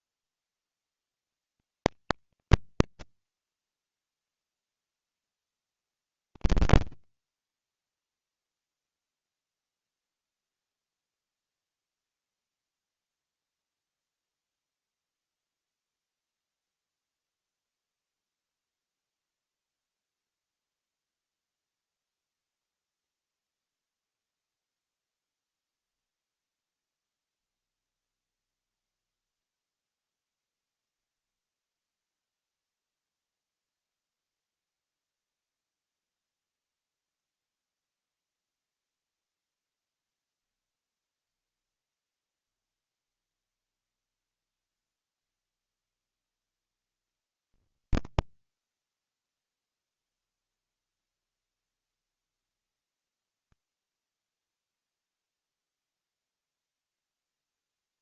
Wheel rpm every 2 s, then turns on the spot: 100, 60, 0, 50, 10, 0, 0, 0, 0, 0, 0, 0, 0, 0, 0, 0, 0, 0, 0, 0, 0, 0, 0, 0, 10, 0, 0, 0, 0.
6-10